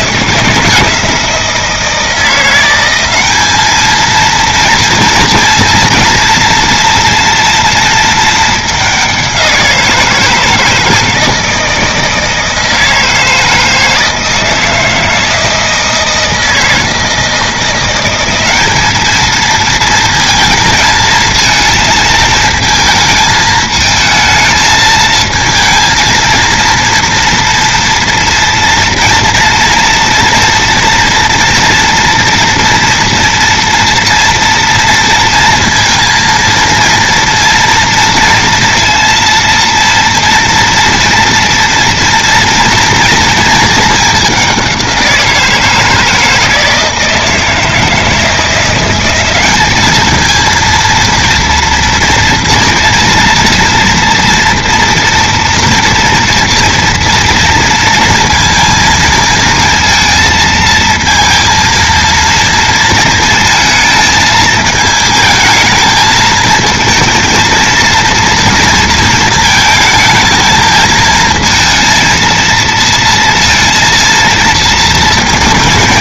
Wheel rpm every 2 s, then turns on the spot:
170, 180, 230, 230, 210, 160, 160, 160, 160, 200, 230, 220, 220, 220, 240, 230, 240, 240, 230, 230, 230, 230, 190, 160, 170, 230, 230, 230, 230, 230, 220, 230, 220, 220, 230, 220, 230, 220.
none